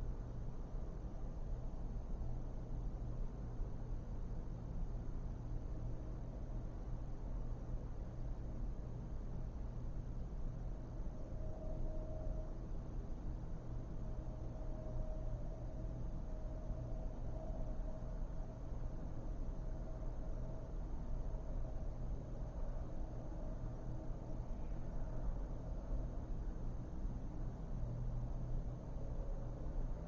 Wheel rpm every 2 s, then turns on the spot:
0, 0, 0, 0, 0, 0, 0, 0, 0, 0, 0, 0, 0, 0, 0.
none